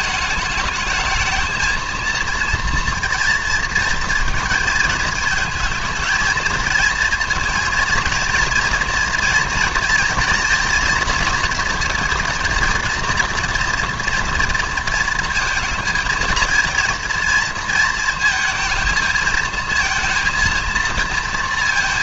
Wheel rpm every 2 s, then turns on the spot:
220, 230, 230, 220, 230, 230, 230, 230, 230, 220, 230.
none